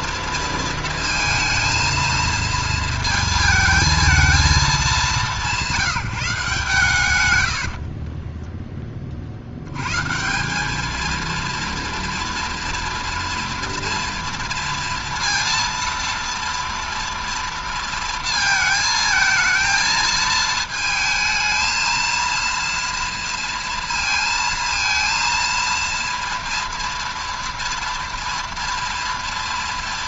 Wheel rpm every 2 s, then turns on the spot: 230, 220, 210, 150, 20, 190, 230, 230, 230, 220, 220, 230, 230, 230, 230.
none